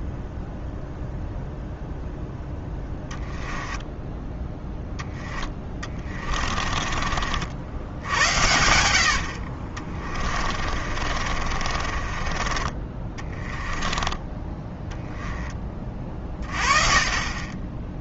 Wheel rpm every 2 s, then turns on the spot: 0, 10, 10, 30, 90, 40, 30, 10, 40.
6-12